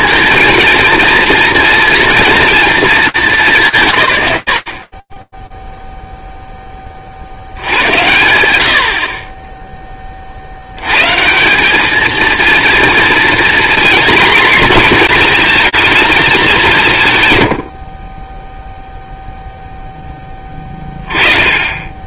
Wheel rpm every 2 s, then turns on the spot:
230, 230, 80, 10, 80, 90, 230, 240, 180, 10, 20.
none